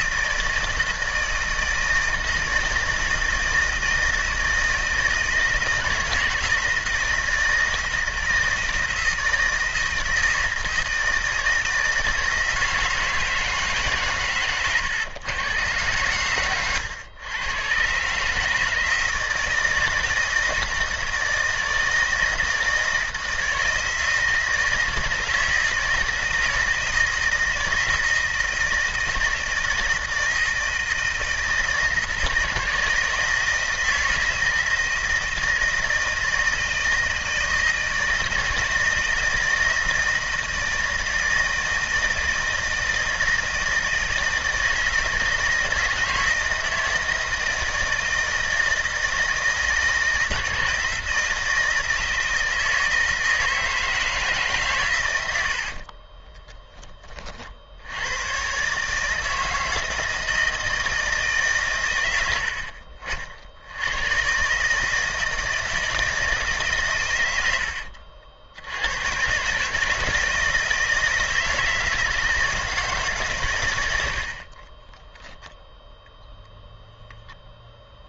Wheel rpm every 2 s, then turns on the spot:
160, 160, 160, 160, 160, 160, 160, 120, 100, 160, 160, 160, 160, 160, 160, 160, 160, 160, 160, 160, 170, 160, 160, 160, 160, 160, 160, 110, 30, 150, 160, 50, 160, 120, 100, 160, 150, 10, 0.
74-76